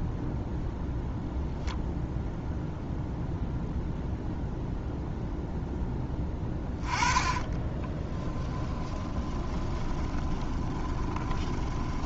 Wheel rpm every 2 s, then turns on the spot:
0, 0, 0, 20, 10, 20.
6-8 10-12